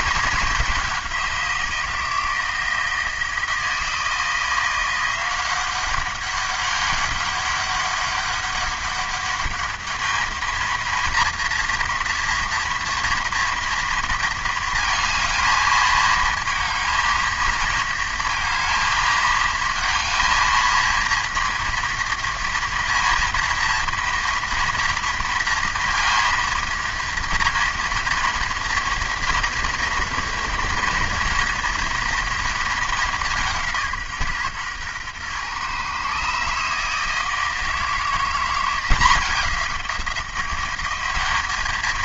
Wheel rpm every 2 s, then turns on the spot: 190, 160, 170, 190, 200, 220, 230, 220, 230, 230, 230, 230, 230, 230, 230, 230, 220, 130, 150, 180, 180.
none